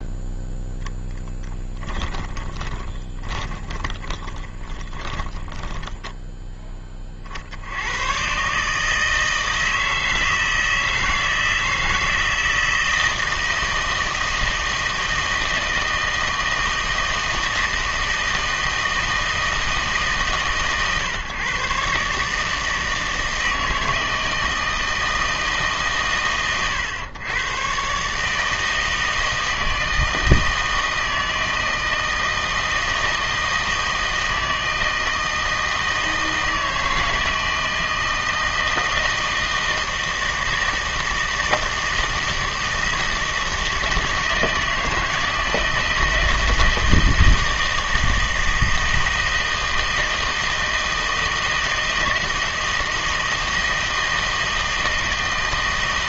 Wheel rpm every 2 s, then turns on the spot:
10, 20, 20, 20, 150, 160, 160, 160, 160, 160, 130, 160, 160, 110, 160, 160, 160, 160, 160, 160, 160, 160, 160, 160, 160, 160, 160, 160.
2-6